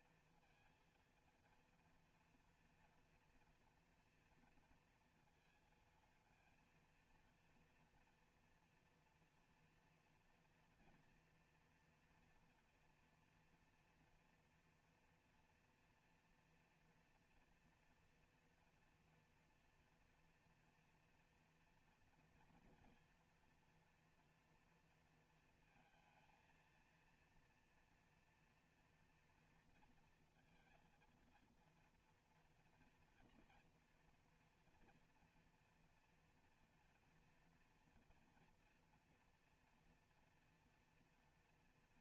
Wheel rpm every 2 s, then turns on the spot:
230, 230, 230, 230, 240, 240, 240, 230, 230, 230, 230, 230, 240, 230, 240, 230, 230, 230, 240, 230, 230.
none